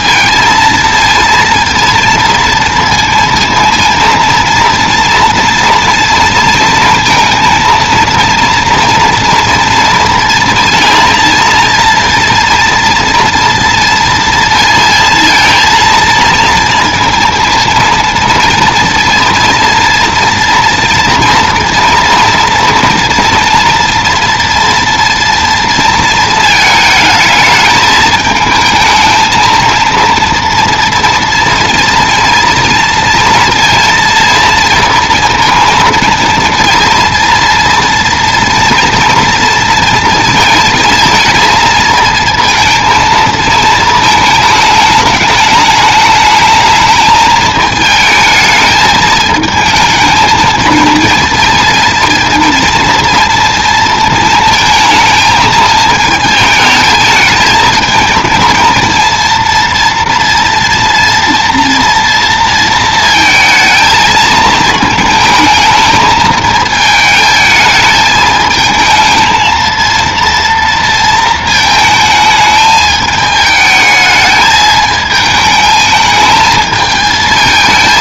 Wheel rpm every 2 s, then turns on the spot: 230, 230, 230, 230, 230, 230, 230, 230, 230, 230, 230, 230, 230, 220, 220, 230, 230, 230, 230, 240, 230, 230, 210, 220, 220, 230, 230, 220, 220, 230, 230, 230, 220, 220, 220, 230, 220, 220, 220.
none